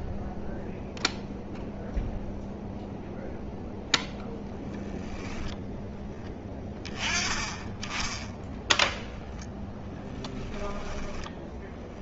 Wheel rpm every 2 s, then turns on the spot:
0, 0, 10, 30, 0, 10.
none